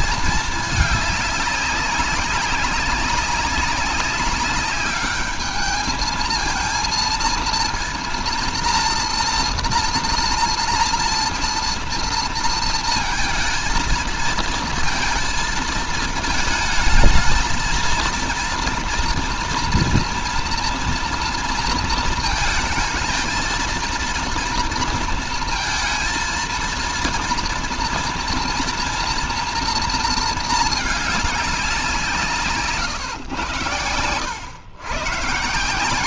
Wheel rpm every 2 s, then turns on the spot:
210, 190, 200, 230, 240, 230, 230, 230, 220, 230, 230, 220, 230, 230, 240, 220, 140, 110.
none